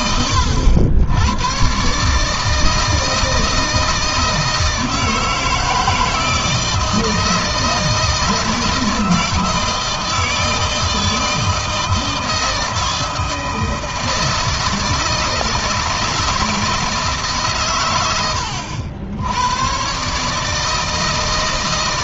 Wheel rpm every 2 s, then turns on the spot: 90, 160, 160, 160, 160, 160, 160, 160, 160, 90, 160.
none